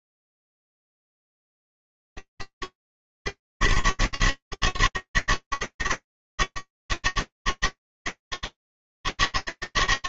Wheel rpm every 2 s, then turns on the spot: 160, 160, 140, 160, 160.
none